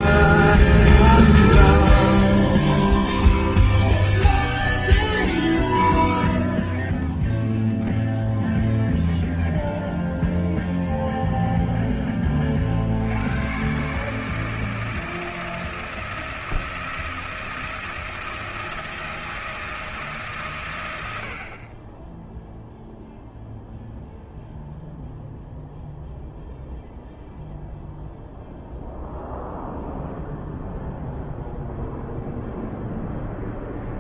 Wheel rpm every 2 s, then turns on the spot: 0, 0, 0, 0, 0, 0, 60, 160, 160, 160, 100, 0, 0, 0, 0, 0, 0.
none